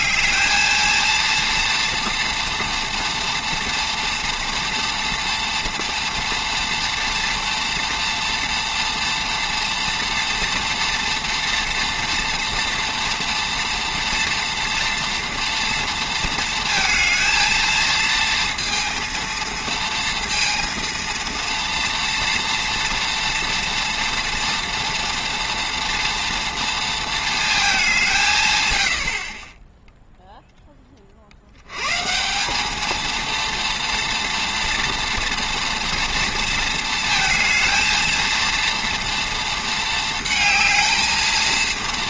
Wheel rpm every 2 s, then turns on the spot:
220, 230, 230, 230, 230, 230, 230, 230, 230, 230, 230, 240, 230, 230, 110, 20, 210, 230, 230, 230, 230.
none